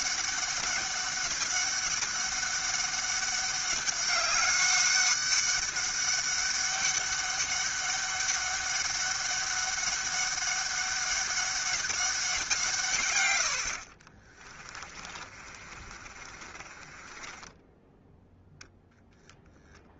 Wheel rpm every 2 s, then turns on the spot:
200, 200, 200, 200, 200, 200, 160, 20, 30, 0.
14-18